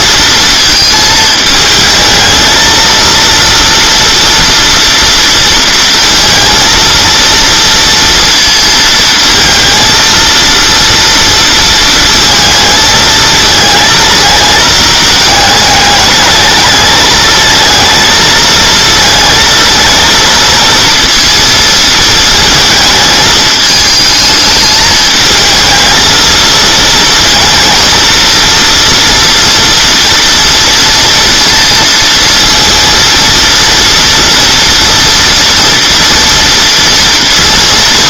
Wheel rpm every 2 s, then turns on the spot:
220, 220, 230, 230, 230, 230, 220, 220, 210, 220, 230, 220, 210, 220, 230, 230, 230, 230, 230.
none